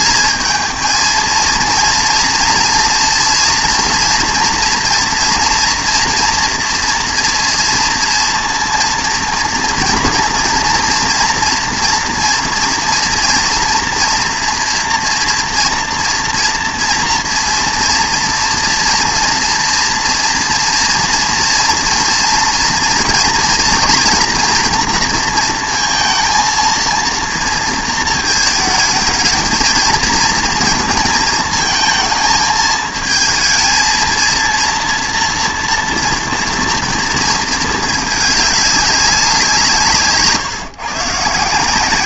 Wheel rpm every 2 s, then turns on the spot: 220, 230, 230, 230, 230, 230, 230, 230, 230, 230, 230, 230, 240, 230, 220, 230, 220, 230, 230, 210, 150.
none